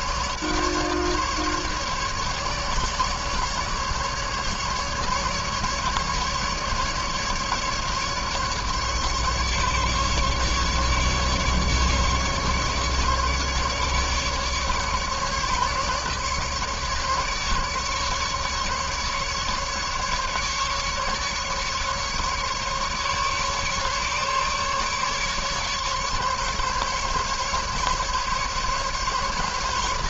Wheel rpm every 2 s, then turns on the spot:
150, 150, 150, 150, 150, 150, 150, 150, 150, 150, 140, 140, 140, 140, 140.
none